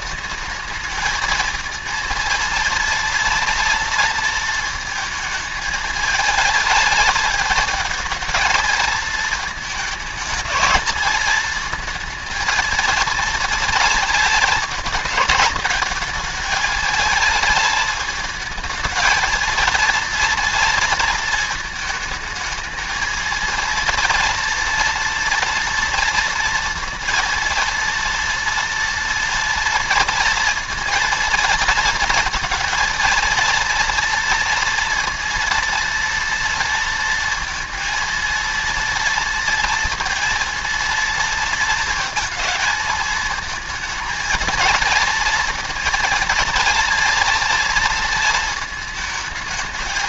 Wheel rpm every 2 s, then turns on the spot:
220, 230, 220, 220, 220, 220, 230, 220, 220, 220, 230, 220, 240, 230, 230, 230, 230, 230, 230, 230, 230, 220, 230, 230, 220.
none